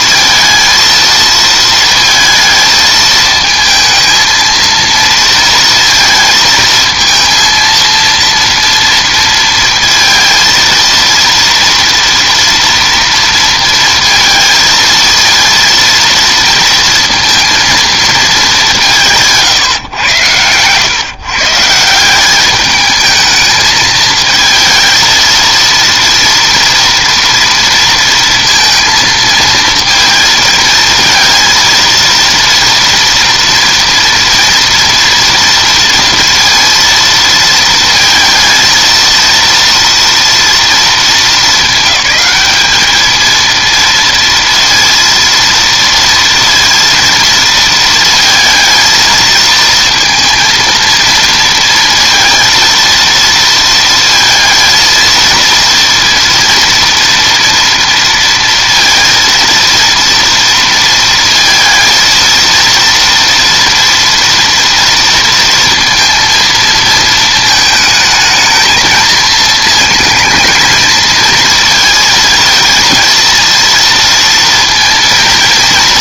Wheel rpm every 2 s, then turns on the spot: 230, 220, 230, 230, 230, 230, 230, 230, 230, 210, 110, 200, 220, 230, 230, 220, 230, 230, 230, 230, 230, 210, 230, 230, 220, 230, 230, 230, 230, 230, 230, 230, 230, 230, 220, 220, 230, 230.
none